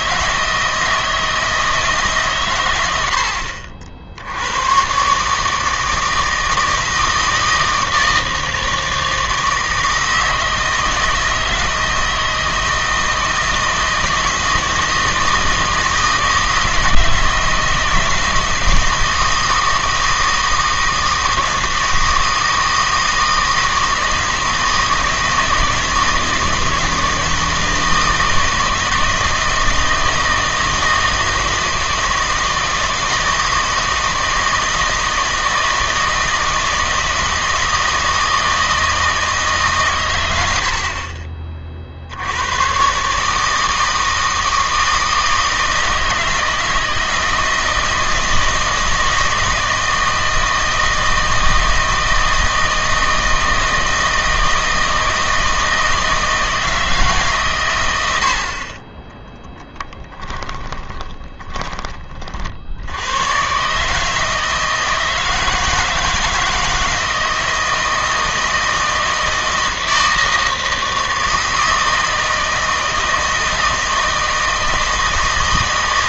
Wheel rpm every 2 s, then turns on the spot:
160, 90, 120, 160, 160, 160, 160, 160, 160, 160, 160, 160, 160, 160, 160, 160, 160, 160, 160, 160, 70, 130, 160, 160, 160, 160, 160, 160, 160, 40, 30, 90, 160, 160, 160, 160, 160, 160.
60-62